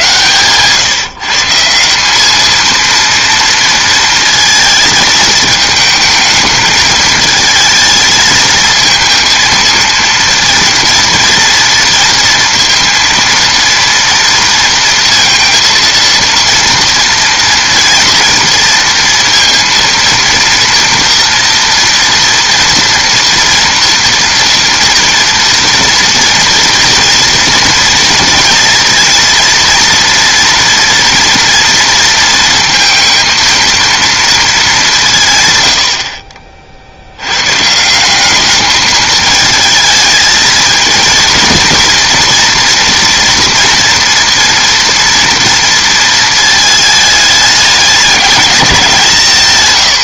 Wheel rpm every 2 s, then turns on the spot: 130, 230, 230, 220, 220, 230, 230, 230, 230, 230, 230, 240, 230, 230, 230, 230, 230, 210, 50, 210, 230, 230, 230, 220, 190.
none